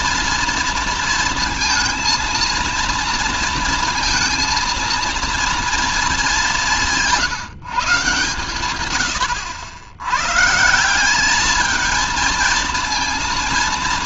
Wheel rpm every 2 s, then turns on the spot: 230, 230, 230, 190, 120, 160, 230.
none